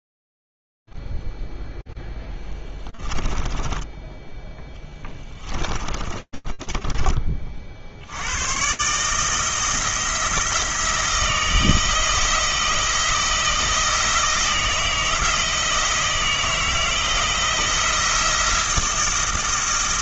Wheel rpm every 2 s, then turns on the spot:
0, 10, 20, 20, 100, 160, 160, 160, 160, 170.
6-8